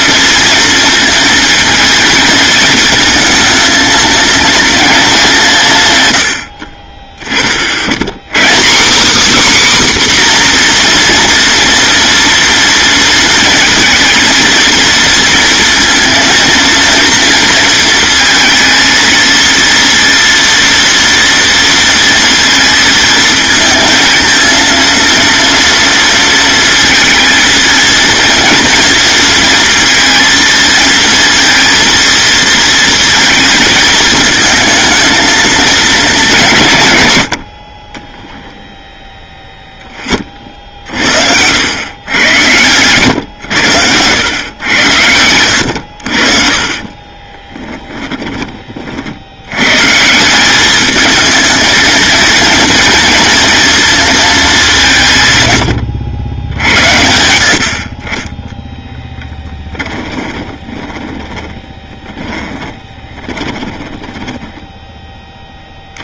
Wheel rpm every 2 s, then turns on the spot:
230, 220, 220, 30, 250, 240, 230, 230, 230, 220, 230, 220, 230, 220, 230, 230, 230, 220, 120, 10, 70, 110, 90, 40, 50, 210, 230, 180, 70, 10, 20, 20, 10.
46-48 60-64